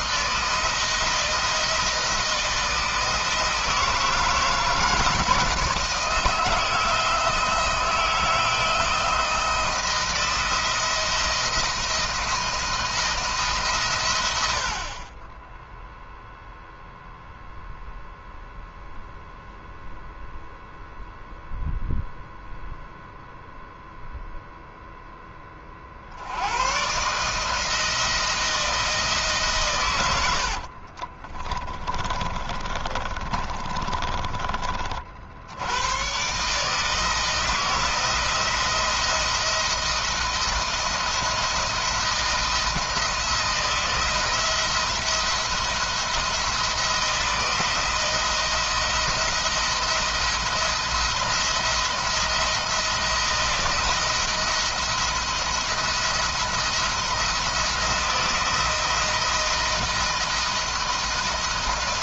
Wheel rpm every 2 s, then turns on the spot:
160, 160, 160, 160, 160, 170, 160, 50, 0, 0, 0, 0, 0, 130, 160, 50, 30, 50, 160, 170, 170, 160, 170, 170, 170, 170, 170, 170, 170, 170, 160.
30-34